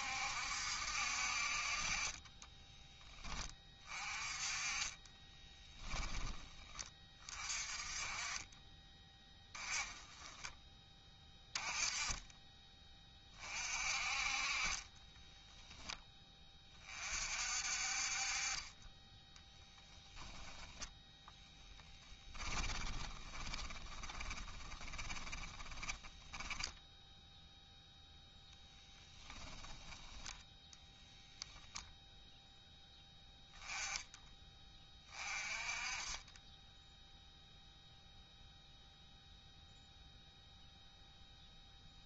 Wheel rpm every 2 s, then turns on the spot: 60, 10, 20, 30, 20, 10, 30, 20, 40, 20, 0, 20, 20, 10, 10, 0, 10, 20, 0, 0, 0.
4-6 14-16 22-26 28-30